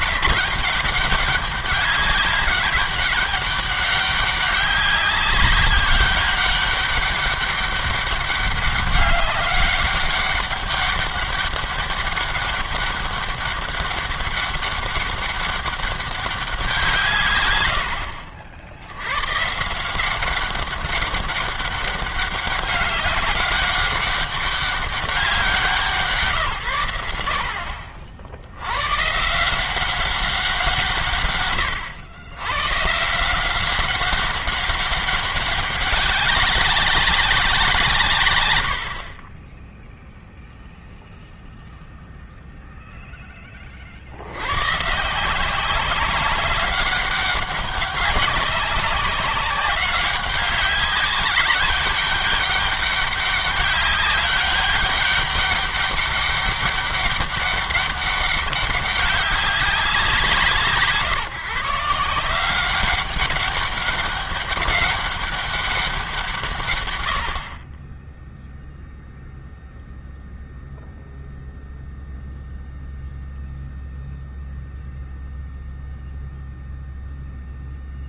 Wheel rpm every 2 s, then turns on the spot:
190, 190, 190, 200, 200, 200, 200, 200, 180, 80, 190, 200, 190, 110, 110, 150, 130, 200, 200, 60, 0, 0, 130, 200, 200, 190, 200, 200, 200, 190, 150, 190, 200, 120, 0, 0, 0, 0, 0.
38-40